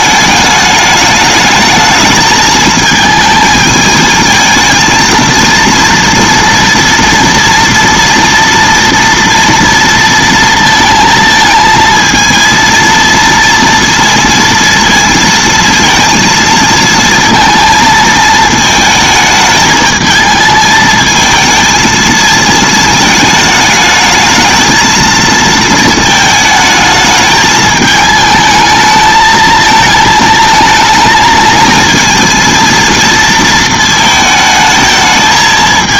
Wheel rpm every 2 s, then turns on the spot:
210, 220, 230, 230, 230, 230, 230, 230, 230, 220, 220, 220, 220, 220, 220, 220, 230, 220.
none